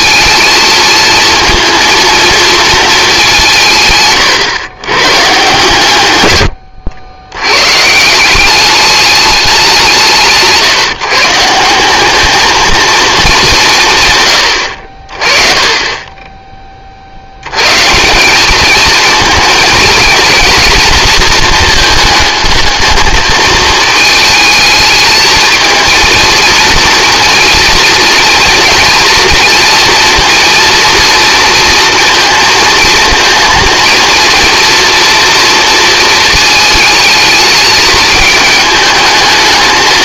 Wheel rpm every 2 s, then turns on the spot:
220, 230, 110, 100, 200, 150, 230, 90, 30, 210, 230, 220, 220, 230, 230, 240, 230, 230, 220, 220.
none